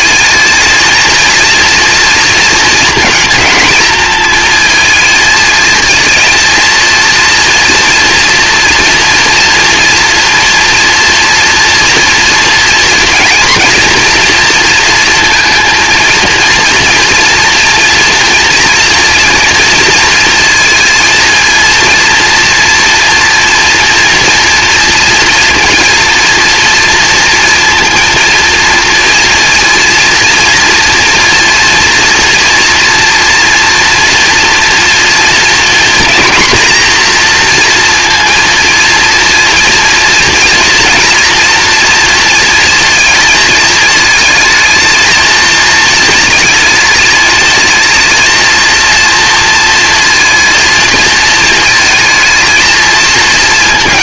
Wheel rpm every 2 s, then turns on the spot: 230, 230, 220, 230, 230, 230, 230, 230, 230, 240, 230, 230, 230, 230, 230, 230, 230, 240, 240, 230, 230, 230, 220, 220, 230, 220, 230.
none